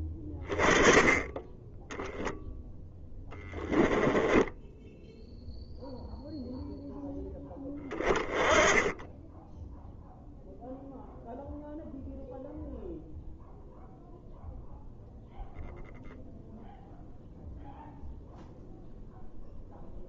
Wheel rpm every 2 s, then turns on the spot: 20, 0, 10, 0, 20, 0, 0, 0, 0, 0.
4-6